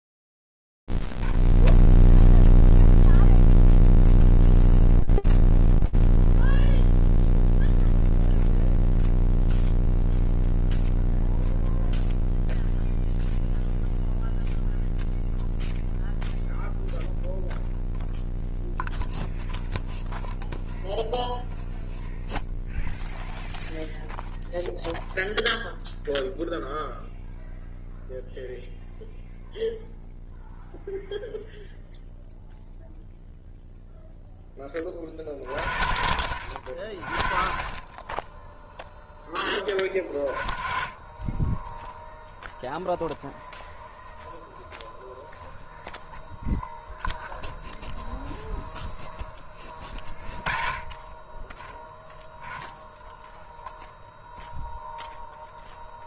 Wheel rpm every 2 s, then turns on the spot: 0, 0, 0, 0, 0, 0, 0, 0, 0, 0, 0, 0, 0, 0, 0, 0, 0, 40, 20, 10, 10, 0, 0, 0, 20, 20, 0, 0.
none